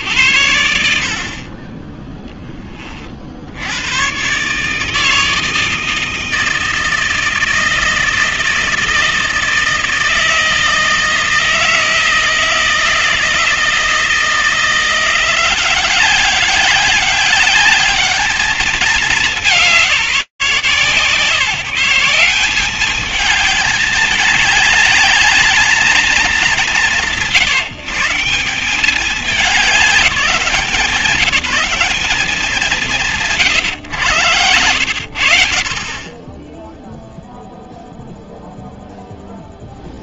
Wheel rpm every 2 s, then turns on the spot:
60, 20, 110, 160, 160, 160, 160, 160, 190, 210, 150, 190, 210, 200, 180, 180, 180, 110, 20, 0.
none